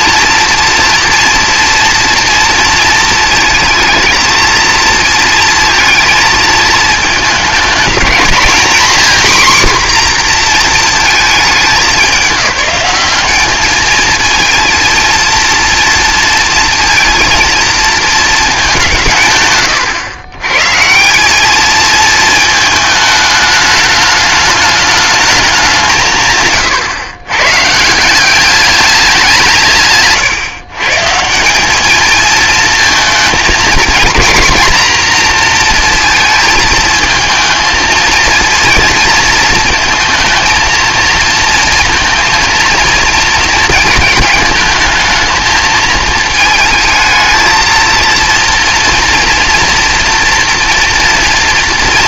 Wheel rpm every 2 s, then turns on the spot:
240, 230, 230, 220, 250, 230, 190, 230, 230, 170, 170, 220, 220, 130, 200, 140, 220, 240, 220, 230, 230, 230, 220, 220, 230, 230.
none